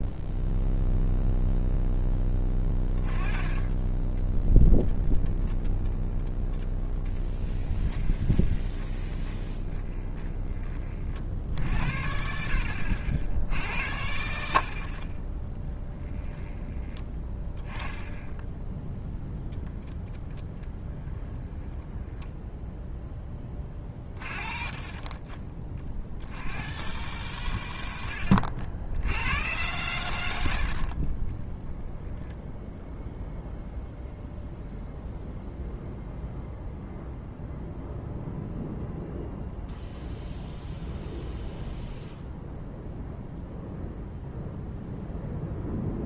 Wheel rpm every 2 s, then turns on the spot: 0, 20, 10, 30, 20, 20, 70, 60, 10, 0, 20, 0, 20, 90, 70, 70, 0, 0, 0, 0, 0, 0, 0.
2-10 20-22 30-32